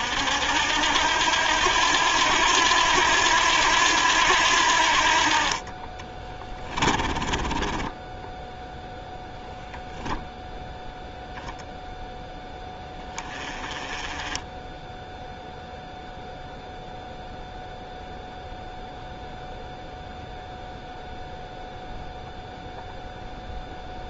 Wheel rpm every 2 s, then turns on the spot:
80, 90, 60, 20, 0, 10, 20, 10, 0, 0, 0, 0.
6-8 10-12